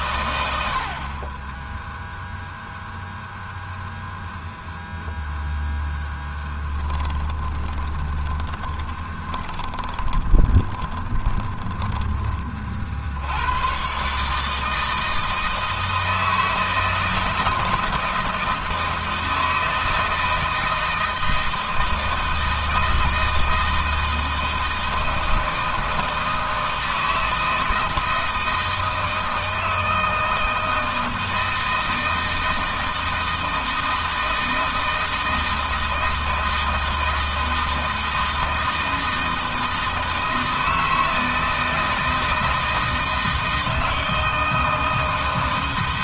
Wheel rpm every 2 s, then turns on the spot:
70, 0, 0, 20, 20, 20, 40, 160, 160, 160, 160, 160, 160, 160, 160, 160, 160, 160, 160, 160, 160, 160, 160.
6-12